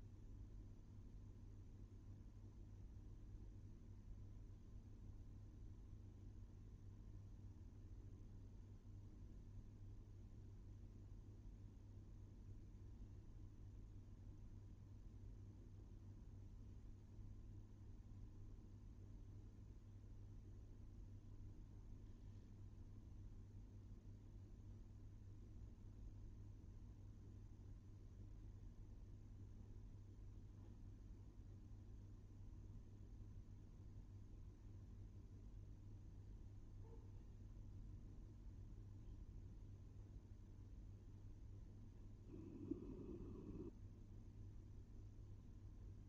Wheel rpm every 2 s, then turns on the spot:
0, 0, 0, 0, 0, 0, 0, 0, 0, 0, 0, 0, 0, 0, 0, 0, 0, 0, 0, 0, 0, 0, 0.
none